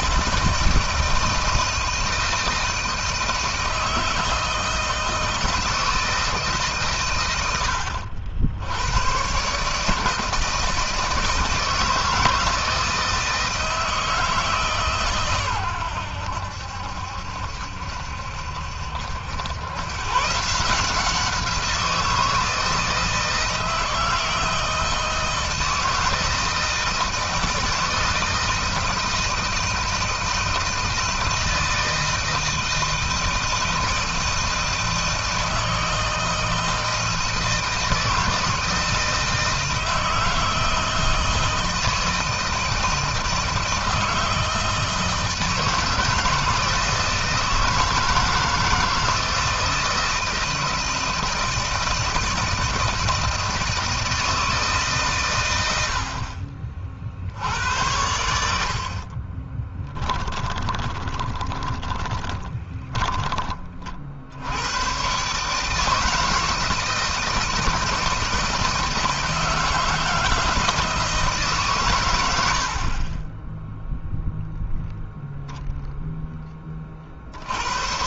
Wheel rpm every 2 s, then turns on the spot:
160, 160, 160, 140, 90, 160, 160, 140, 70, 70, 160, 160, 160, 160, 160, 160, 160, 160, 160, 160, 160, 160, 160, 160, 160, 160, 160, 140, 40, 60, 20, 10, 110, 160, 160, 160, 50, 0, 40.
58-62